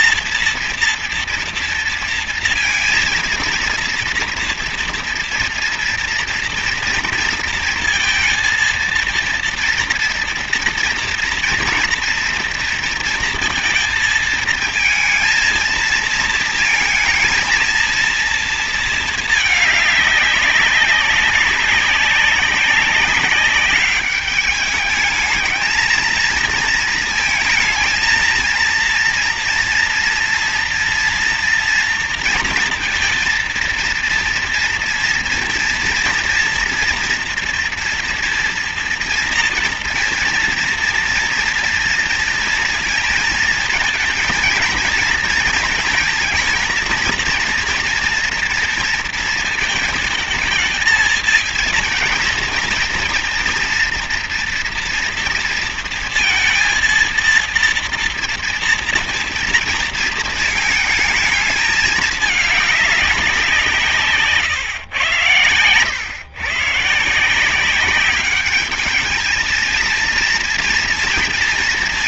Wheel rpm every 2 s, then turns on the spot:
230, 230, 230, 230, 230, 230, 230, 220, 230, 230, 200, 190, 200, 220, 230, 230, 230, 230, 230, 230, 230, 230, 230, 230, 230, 220, 230, 240, 230, 230, 220, 210, 120, 130, 210, 230.
none